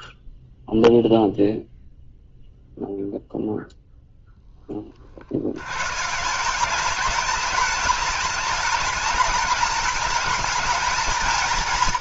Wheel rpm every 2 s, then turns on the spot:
0, 0, 20, 200, 210, 220.
none